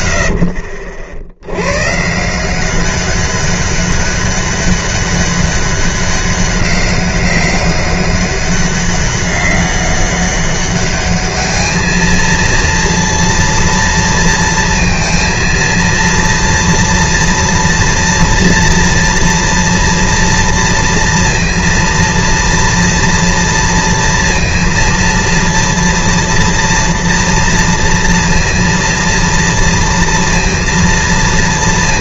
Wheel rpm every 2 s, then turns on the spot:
50, 170, 200, 190, 200, 200, 230, 230, 230, 230, 230, 230, 230, 230, 230, 230.
none